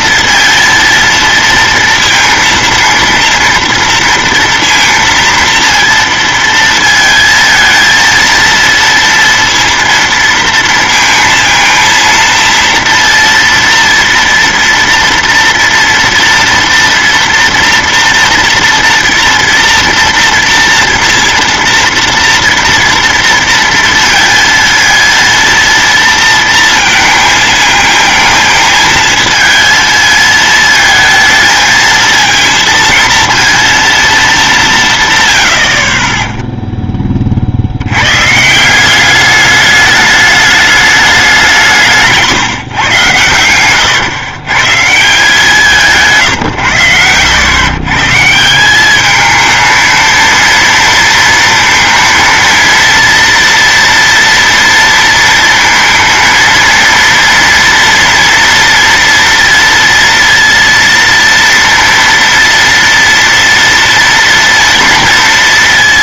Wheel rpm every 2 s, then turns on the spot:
230, 230, 230, 230, 230, 230, 230, 230, 230, 230, 230, 230, 230, 230, 220, 220, 230, 220, 20, 130, 210, 150, 120, 140, 150, 230, 230, 230, 230, 230, 230, 230, 230.
42-44 46-48